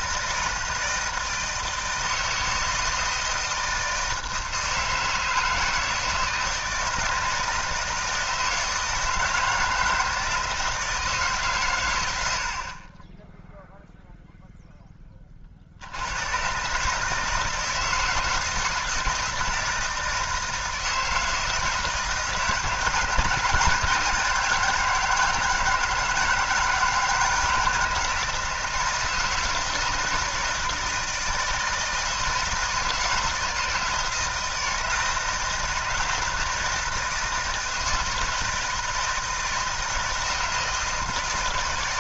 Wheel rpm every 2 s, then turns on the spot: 160, 160, 160, 160, 160, 160, 40, 0, 130, 160, 160, 160, 170, 160, 160, 160, 160, 160, 160, 160, 160.
none